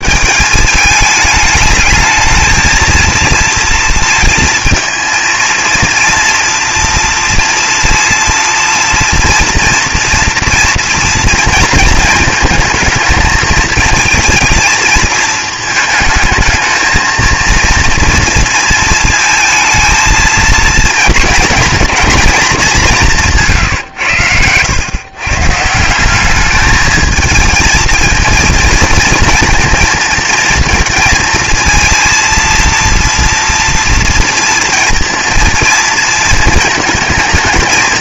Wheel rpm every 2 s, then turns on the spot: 210, 230, 230, 230, 230, 230, 220, 220, 220, 230, 230, 190, 120, 210, 230, 220, 230, 230, 230.
none